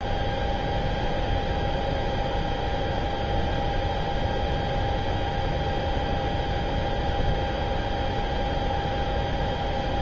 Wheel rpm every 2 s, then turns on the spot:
0, 0, 0, 0, 0.
none